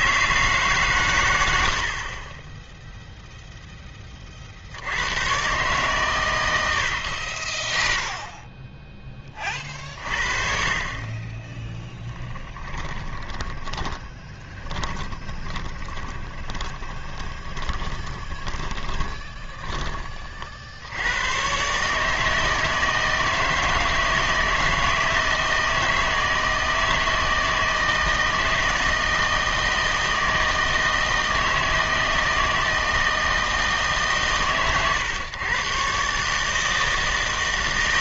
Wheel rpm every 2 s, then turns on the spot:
150, 10, 40, 100, 10, 40, 10, 10, 20, 20, 60, 160, 160, 160, 160, 160, 160, 130, 160.
12-20